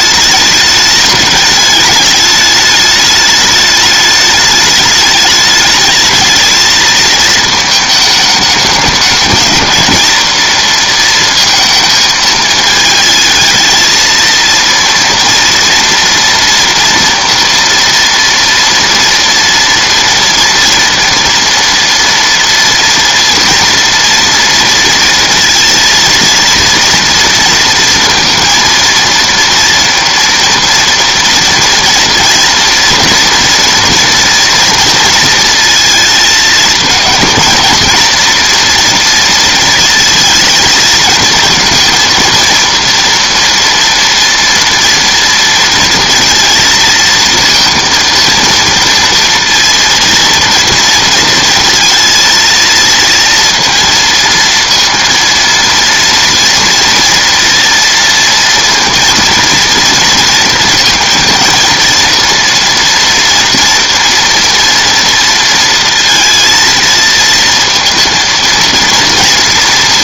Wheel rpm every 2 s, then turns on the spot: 210, 210, 210, 220, 210, 230, 220, 230, 240, 230, 230, 230, 230, 230, 230, 230, 240, 230, 220, 240, 220, 230, 230, 230, 230, 230, 230, 230, 230, 230, 230, 230, 230, 230, 230.
none